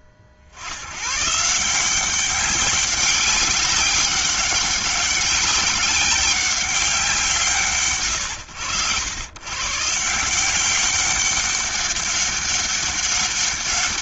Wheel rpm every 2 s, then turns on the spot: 70, 200, 190, 190, 100, 180, 200.
none